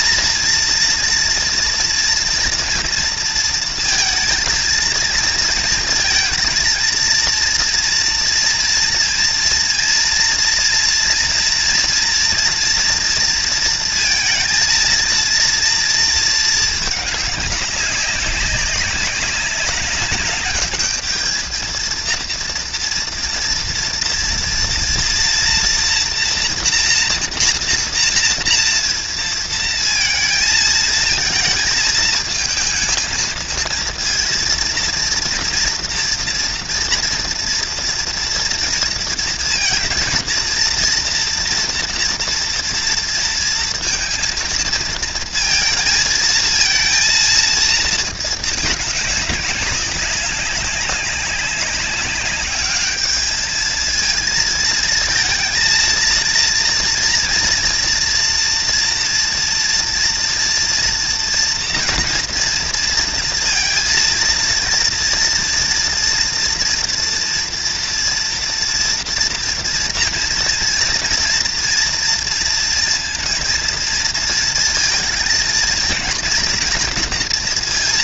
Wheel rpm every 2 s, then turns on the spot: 230, 230, 230, 230, 230, 230, 230, 230, 210, 200, 210, 240, 230, 240, 230, 220, 230, 230, 240, 230, 230, 230, 230, 230, 200, 200, 210, 220, 230, 230, 230, 230, 230, 230, 230, 230, 230, 230, 230.
none